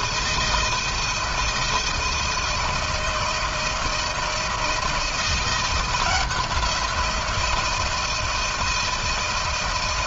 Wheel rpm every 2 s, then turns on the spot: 160, 160, 160, 170, 160.
none